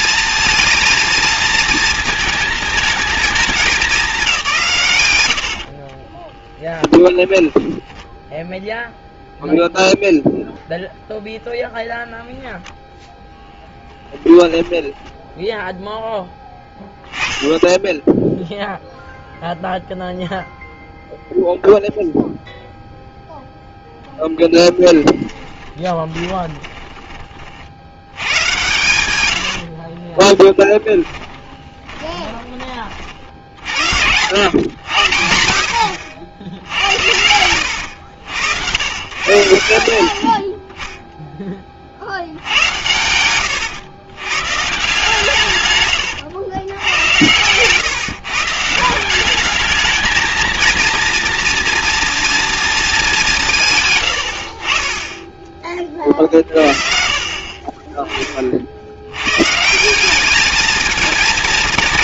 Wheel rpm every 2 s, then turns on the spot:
230, 220, 120, 20, 0, 0, 10, 0, 10, 0, 0, 0, 10, 30, 110, 10, 50, 80, 80, 100, 10, 100, 140, 110, 180, 230, 210, 30, 30, 70, 230.
6-8 24-26 30-32 36-38